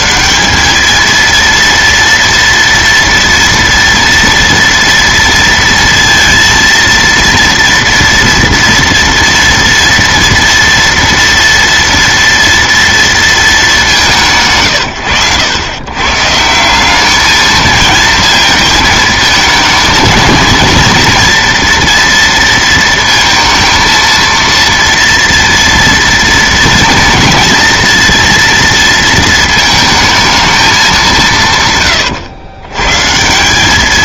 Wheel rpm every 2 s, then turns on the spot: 190, 230, 230, 230, 230, 240, 230, 130, 170, 220, 230, 230, 230, 230, 230, 210, 110.
none